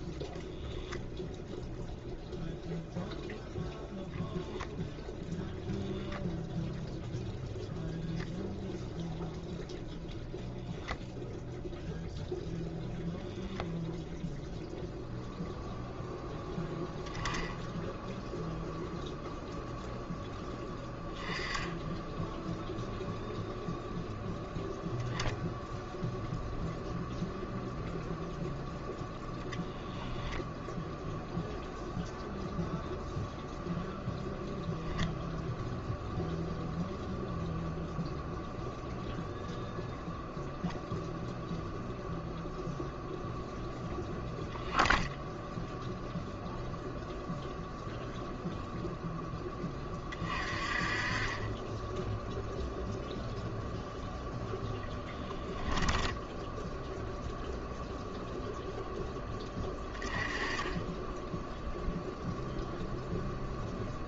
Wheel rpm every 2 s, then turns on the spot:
0, 0, 0, 0, 0, 0, 0, 0, 0, 0, 10, 0, 0, 0, 0, 0, 0, 0, 0, 0, 0, 0, 0, 0, 0, 40, 0, 0, 0, 0, 10, 0.
none